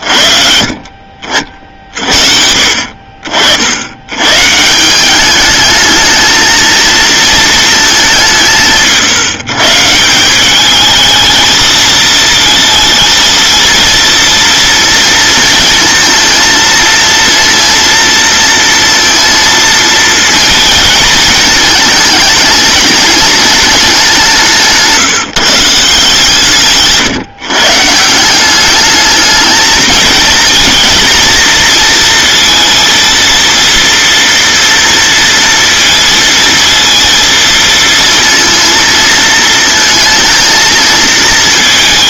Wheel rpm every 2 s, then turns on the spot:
50, 60, 150, 230, 160, 210, 230, 230, 230, 230, 230, 210, 170, 150, 200, 230, 230, 230, 230, 230, 230.
24-26